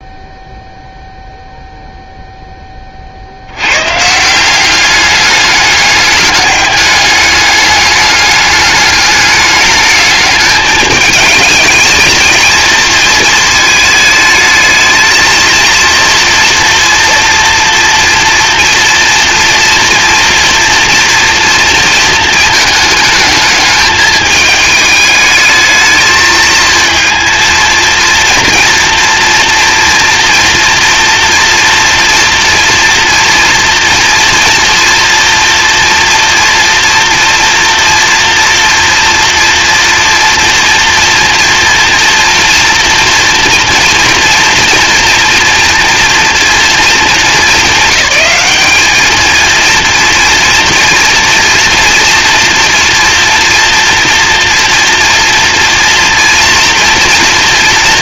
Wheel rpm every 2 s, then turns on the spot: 0, 20, 190, 210, 210, 210, 230, 220, 230, 230, 230, 220, 210, 220, 230, 230, 240, 230, 230, 230, 240, 230, 230, 230, 210, 230, 230, 230, 230.
none